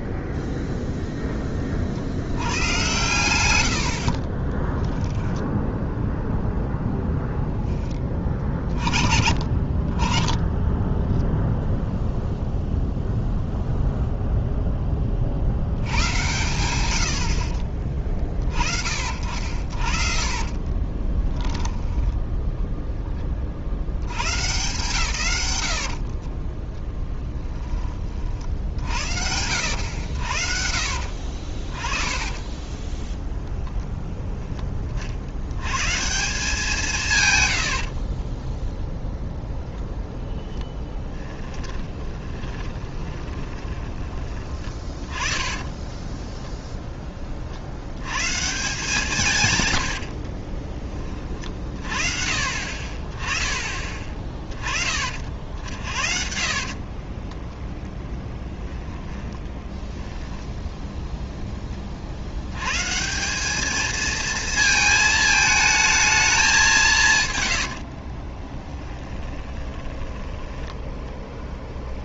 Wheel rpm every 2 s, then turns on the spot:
0, 100, 20, 0, 40, 10, 0, 10, 100, 40, 30, 10, 120, 10, 60, 60, 20, 20, 170, 0, 10, 20, 20, 10, 170, 40, 40, 30, 40, 10, 0, 130, 220, 170, 20, 10.
4-6 20-22 30-34 40-44 50-52 56-60 68-70